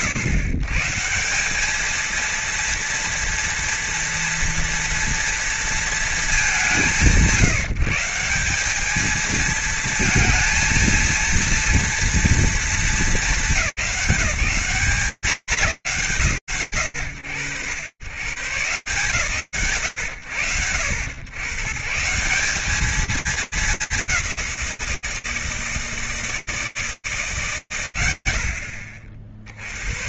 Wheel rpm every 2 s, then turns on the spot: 130, 230, 230, 170, 190, 220, 220, 190, 100, 170, 90, 200, 180, 160, 70.
none